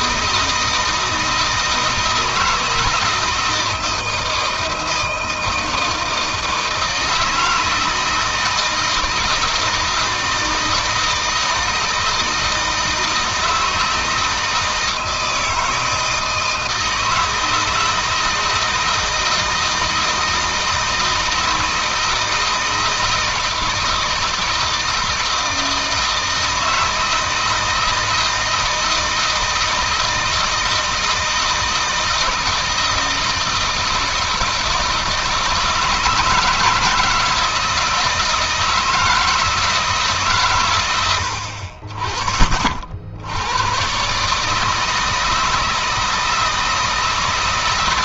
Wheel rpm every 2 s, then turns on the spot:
160, 160, 160, 160, 170, 160, 160, 160, 160, 160, 160, 160, 160, 160, 160, 160, 160, 160, 160, 160, 120, 40, 150, 160.
none